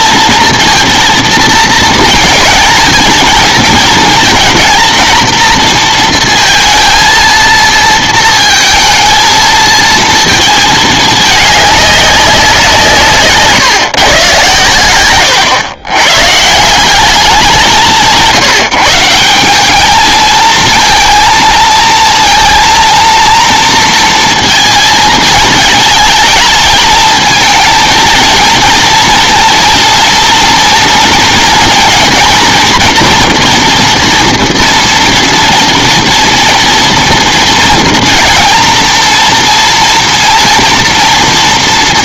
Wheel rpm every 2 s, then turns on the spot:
230, 230, 230, 230, 230, 220, 170, 110, 150, 160, 220, 230, 230, 220, 230, 230, 230, 230, 230, 230, 230.
none